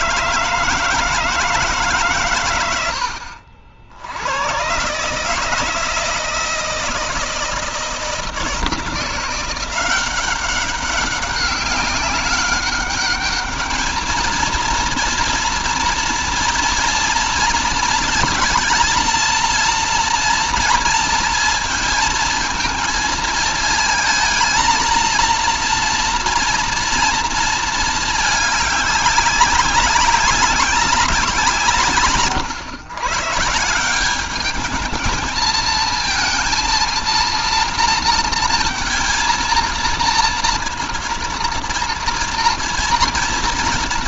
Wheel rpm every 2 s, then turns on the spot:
160, 120, 100, 160, 160, 190, 200, 230, 230, 230, 230, 230, 230, 240, 210, 190, 130, 210, 230, 230, 230, 230.
none